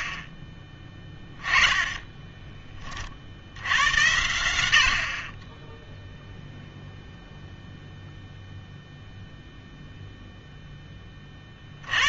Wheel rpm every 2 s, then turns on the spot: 20, 10, 80, 0, 0, 0.
none